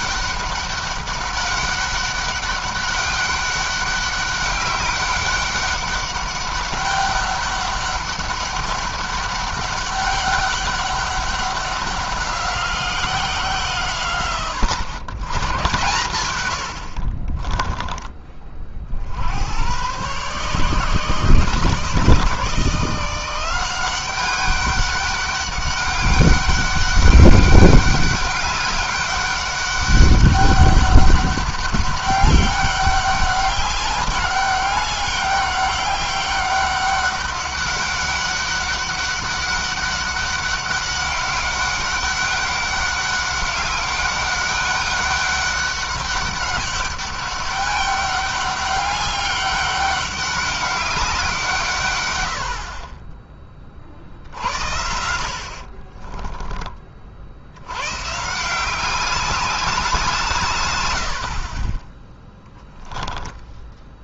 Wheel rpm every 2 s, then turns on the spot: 200, 200, 200, 200, 200, 200, 180, 100, 50, 60, 150, 170, 200, 200, 200, 200, 200, 200, 200, 200, 200, 200, 200, 200, 200, 190, 40, 70, 30, 180, 100, 10.
16-18 52-54 62-64